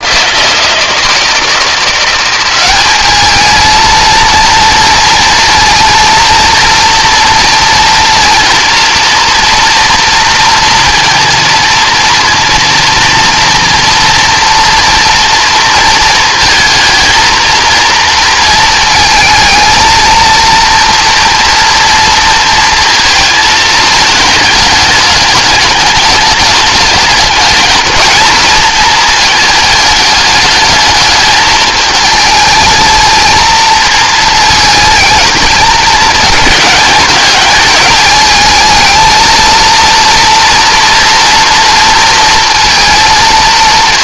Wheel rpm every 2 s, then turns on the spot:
170, 210, 230, 230, 230, 230, 230, 230, 230, 230, 230, 220, 210, 210, 220, 220, 220, 220, 210, 220, 230, 230.
none